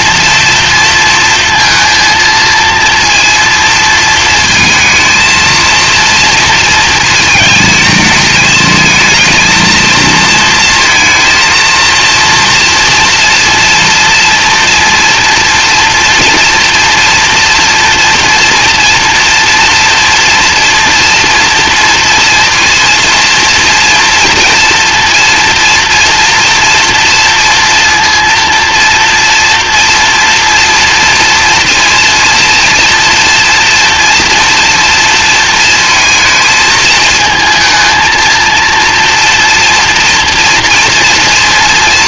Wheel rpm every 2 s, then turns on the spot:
230, 230, 230, 230, 220, 230, 230, 230, 230, 230, 240, 230, 230, 230, 230, 230, 230, 230, 220, 230, 230.
none